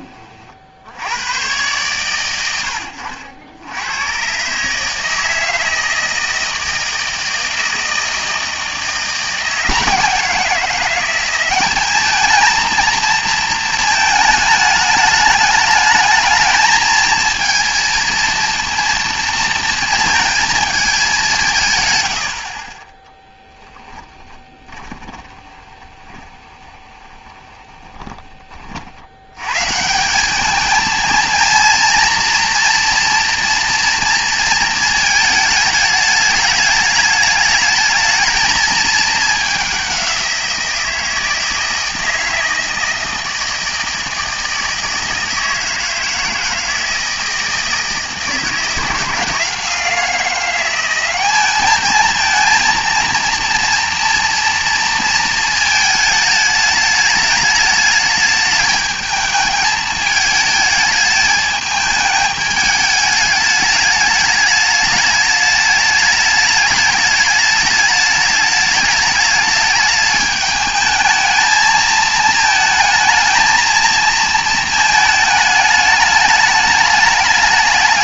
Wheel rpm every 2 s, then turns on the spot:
60, 90, 150, 160, 170, 180, 230, 210, 220, 230, 210, 20, 20, 20, 50, 220, 240, 220, 210, 220, 170, 160, 160, 160, 160, 190, 230, 230, 210, 210, 220, 210, 210, 210, 210, 220, 220, 220, 210.
24-28